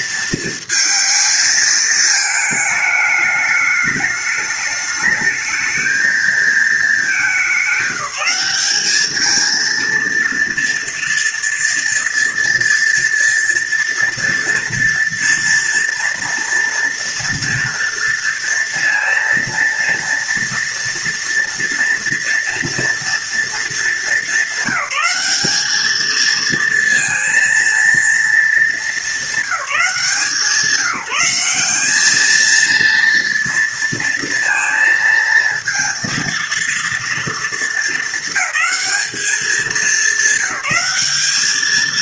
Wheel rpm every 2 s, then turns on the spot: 230, 220, 210, 220, 190, 230, 230, 240, 240, 230, 230, 240, 220, 230, 220, 170, 230, 230, 230, 220, 200.
none